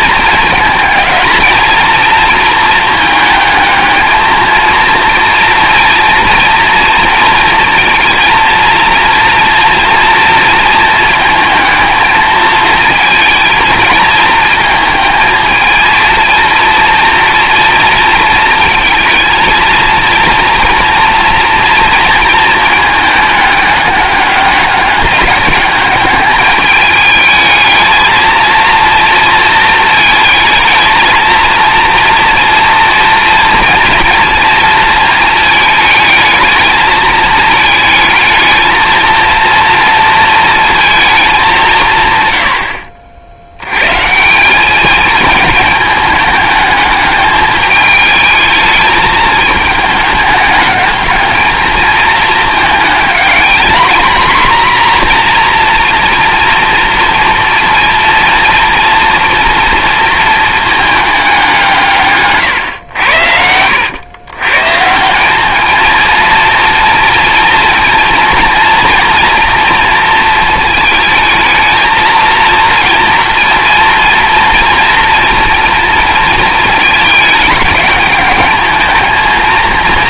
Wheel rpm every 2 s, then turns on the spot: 220, 220, 220, 230, 230, 230, 220, 220, 230, 230, 230, 220, 200, 210, 230, 220, 230, 220, 220, 220, 230, 90, 200, 210, 210, 210, 220, 240, 230, 230, 220, 130, 140, 230, 230, 220, 230, 240, 230, 220.
62-64